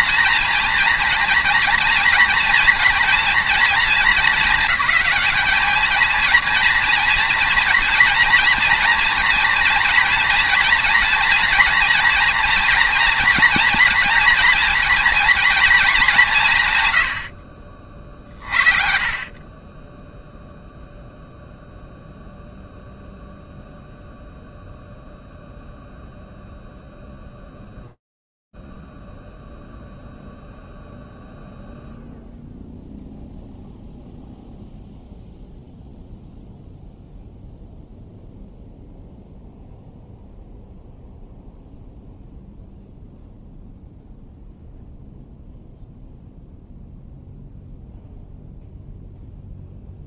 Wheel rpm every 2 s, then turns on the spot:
240, 230, 220, 230, 230, 230, 240, 240, 130, 50, 0, 0, 0, 0, 0, 0, 0, 0, 0, 0, 0, 0, 0, 0, 0.
none